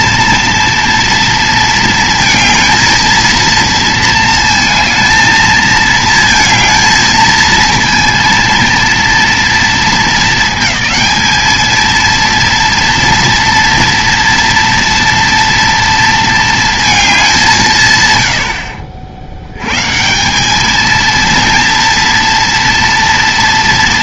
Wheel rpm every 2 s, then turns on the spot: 230, 220, 230, 220, 230, 220, 230, 230, 230, 90, 190, 230.
none